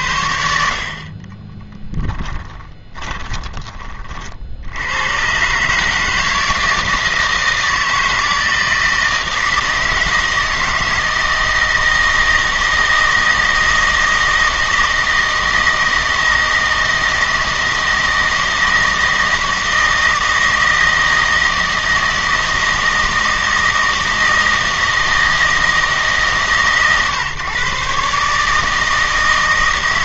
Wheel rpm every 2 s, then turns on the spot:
60, 30, 90, 160, 160, 160, 160, 160, 160, 160, 160, 160, 160, 140, 160.
2-4